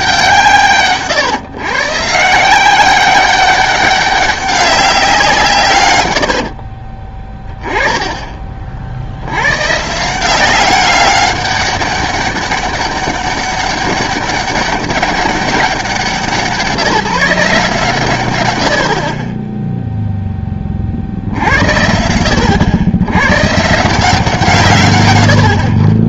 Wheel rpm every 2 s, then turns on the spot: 150, 180, 200, 50, 40, 190, 200, 200, 160, 100, 30, 80, 140.
6-8